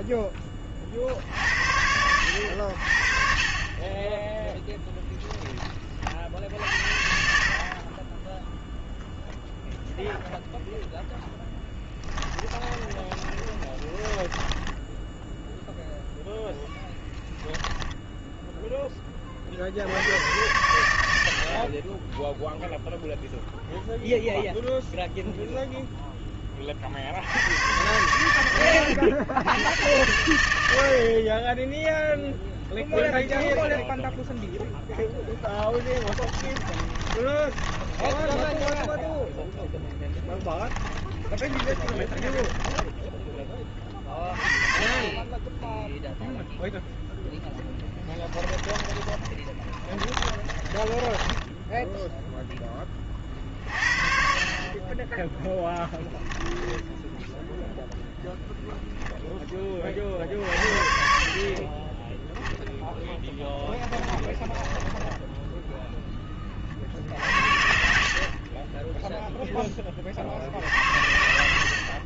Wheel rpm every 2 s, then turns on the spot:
30, 70, 10, 60, 10, 0, 10, 10, 10, 0, 90, 0, 0, 20, 90, 90, 0, 0, 10, 10, 10, 10, 30, 0, 20, 20, 0, 40, 10, 0, 50, 0, 10, 30, 30, 50.
12-16 36-40 42-44 48-52 56-58 64-66 68-70